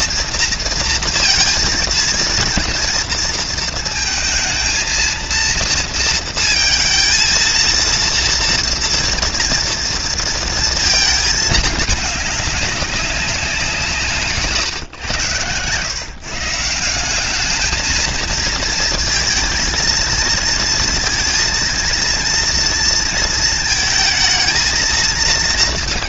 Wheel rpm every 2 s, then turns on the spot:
230, 230, 220, 230, 230, 220, 200, 130, 170, 220, 230, 230, 230.
none